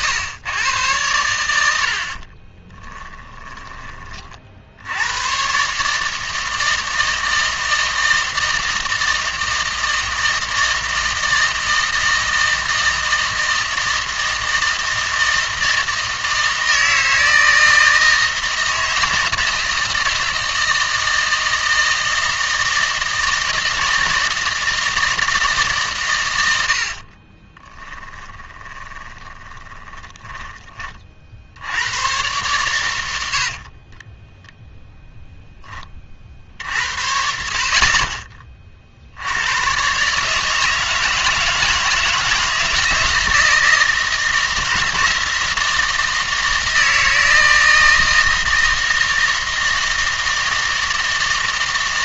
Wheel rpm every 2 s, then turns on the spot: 110, 20, 70, 160, 160, 160, 160, 160, 160, 160, 160, 160, 160, 70, 20, 20, 100, 0, 60, 40, 150, 160, 160, 160, 160, 160.
2-4 26-30